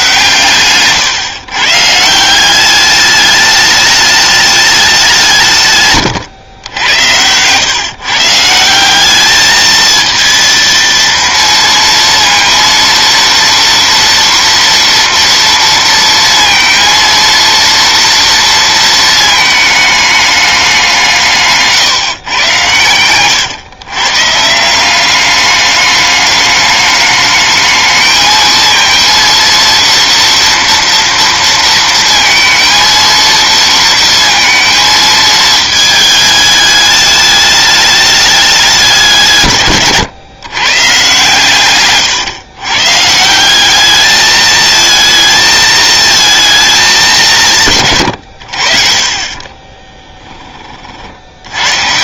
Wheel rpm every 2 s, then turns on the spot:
130, 200, 200, 100, 180, 230, 230, 230, 230, 230, 190, 110, 180, 210, 230, 230, 230, 230, 210, 180, 120, 130, 220, 220, 60, 40.
none